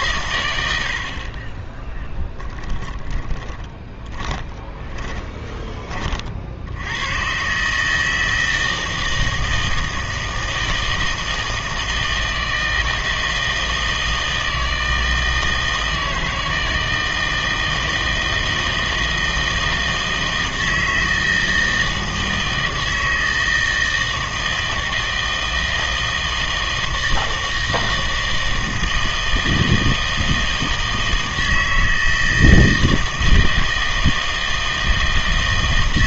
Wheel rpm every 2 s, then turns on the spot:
90, 10, 20, 80, 160, 160, 160, 160, 160, 160, 160, 160, 160, 160, 160, 160, 160, 160.
2-6